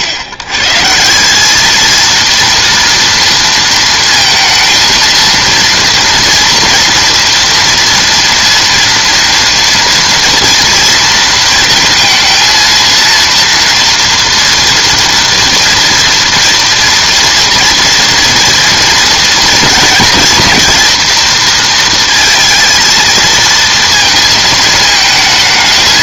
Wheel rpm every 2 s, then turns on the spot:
130, 230, 230, 230, 230, 230, 230, 230, 230, 230, 230, 230, 220.
none